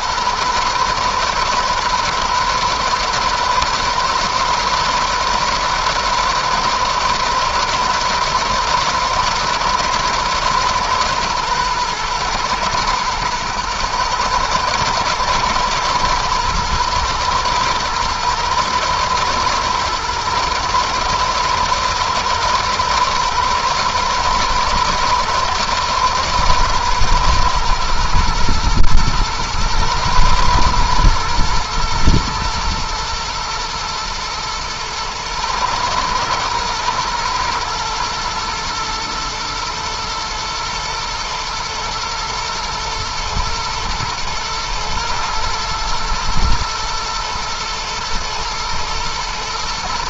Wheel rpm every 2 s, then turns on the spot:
110, 110, 120, 120, 110, 110, 120, 110, 120, 110, 110, 110, 110, 110, 110, 110, 110, 110, 120, 120, 110, 120, 110, 110, 110.
none